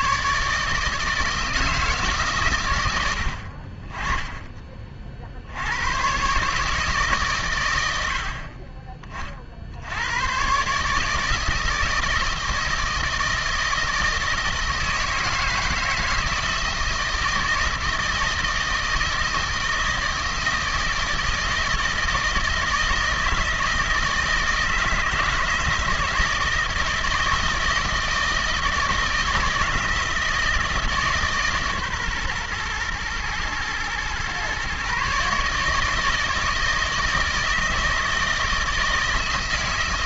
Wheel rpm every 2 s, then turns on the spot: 150, 130, 20, 150, 30, 120, 160, 160, 160, 160, 160, 160, 160, 160, 170, 160, 120, 130, 160, 160.
8-10